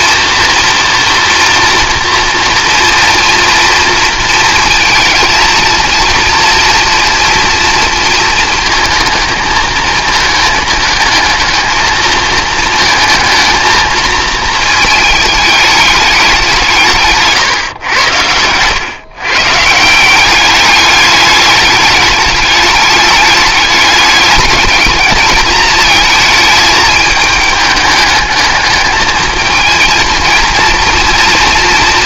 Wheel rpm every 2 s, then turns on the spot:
240, 230, 220, 230, 230, 220, 230, 220, 180, 110, 200, 210, 210, 220, 210, 230.
none